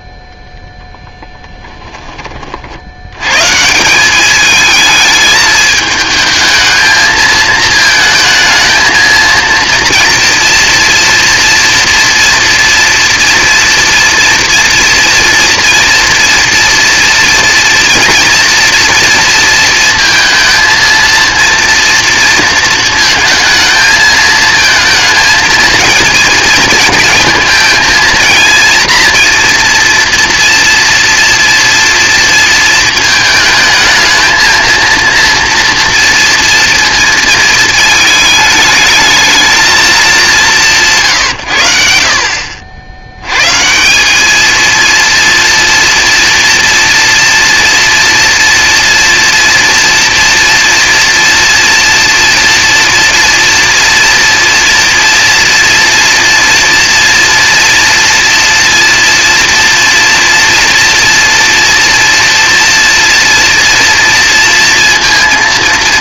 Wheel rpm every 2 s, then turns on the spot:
0, 50, 210, 220, 220, 240, 230, 230, 230, 230, 230, 230, 220, 230, 230, 230, 230, 230, 230, 210, 180, 60, 220, 230, 230, 230, 230, 230, 230, 240, 240, 240, 230.
none